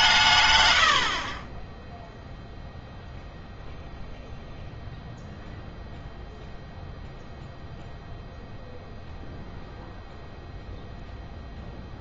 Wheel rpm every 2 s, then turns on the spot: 120, 0, 0, 0, 0, 0.
none